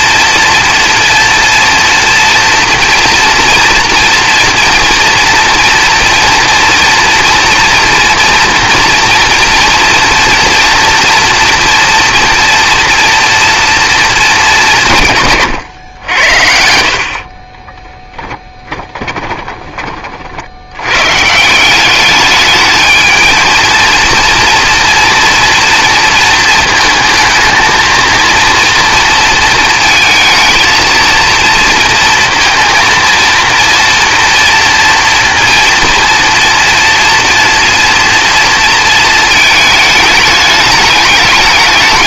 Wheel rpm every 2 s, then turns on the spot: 230, 230, 230, 230, 240, 230, 230, 190, 80, 10, 90, 210, 230, 220, 230, 230, 230, 230, 240, 230, 210.
18-20